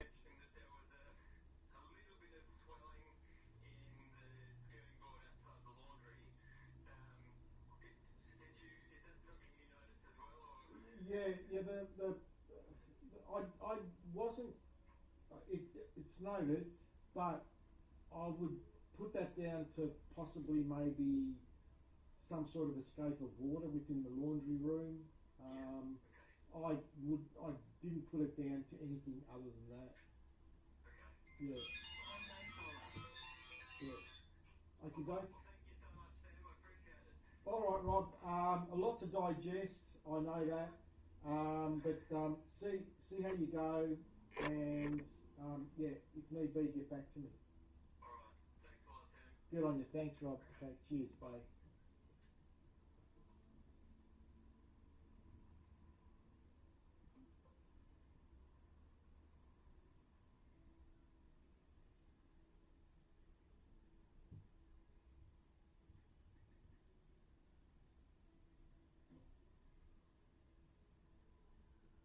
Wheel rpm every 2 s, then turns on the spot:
0, 0, 0, 0, 0, 0, 0, 0, 0, 0, 0, 0, 0, 0, 0, 0, 0, 0, 0, 0, 0, 0, 0, 0, 0, 0, 0, 0, 0, 0, 0, 0, 0, 0, 0, 0.
none